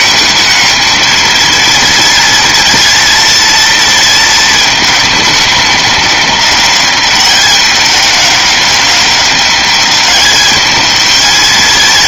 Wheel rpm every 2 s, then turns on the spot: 220, 230, 230, 210, 210, 220.
none